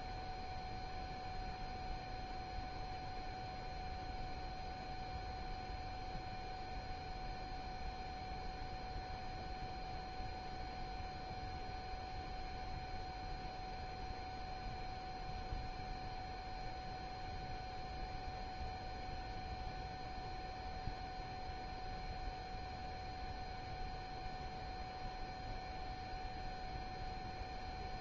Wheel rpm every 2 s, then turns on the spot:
0, 0, 0, 0, 0, 0, 0, 0, 0, 0, 0, 0, 0, 0.
none